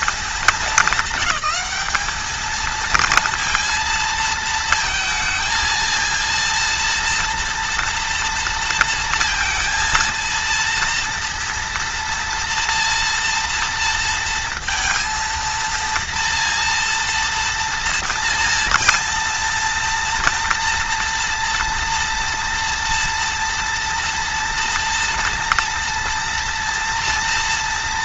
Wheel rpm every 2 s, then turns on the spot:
190, 230, 230, 230, 230, 230, 230, 230, 230, 230, 230, 230, 230, 230.
none